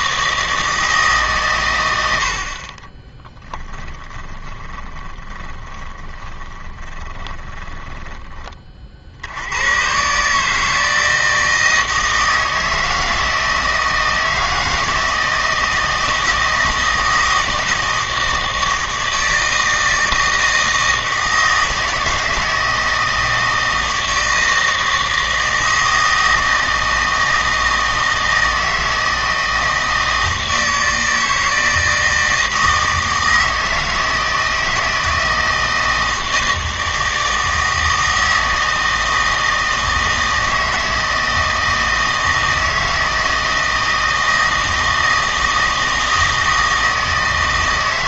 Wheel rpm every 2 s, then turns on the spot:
160, 40, 20, 20, 30, 160, 160, 160, 160, 160, 160, 160, 160, 160, 160, 160, 160, 160, 160, 160, 160, 160, 160, 160.
2-8